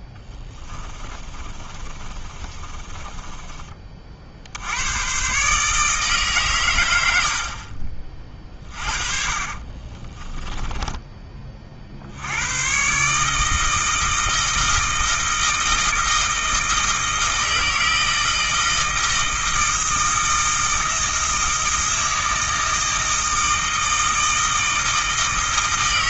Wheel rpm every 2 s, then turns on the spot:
20, 20, 100, 110, 30, 20, 140, 160, 160, 160, 160, 160, 160.
0-4 8-12